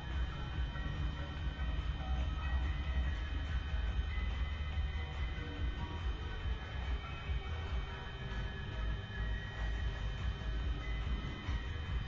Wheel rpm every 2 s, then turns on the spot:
0, 0, 0, 0, 0, 0.
none